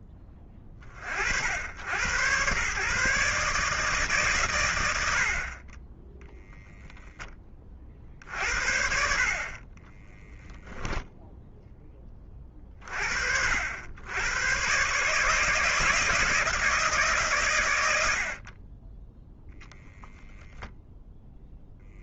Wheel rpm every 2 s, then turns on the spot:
40, 130, 90, 0, 50, 0, 40, 130, 160, 30, 10.
none